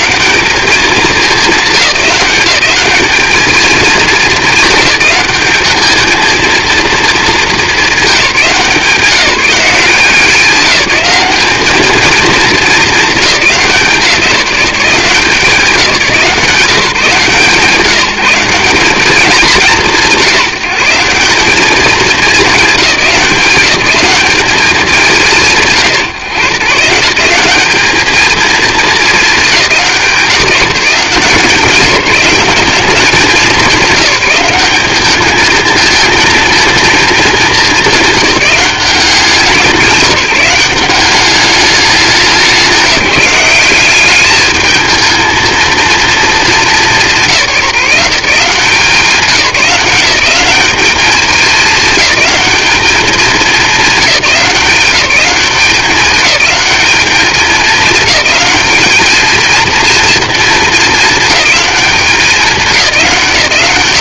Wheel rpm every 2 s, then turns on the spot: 200, 200, 210, 230, 170, 200, 210, 170, 170, 190, 160, 190, 200, 150, 220, 180, 190, 200, 230, 190, 190, 200, 210, 210, 170, 200, 210, 190, 210, 210, 220, 180.
none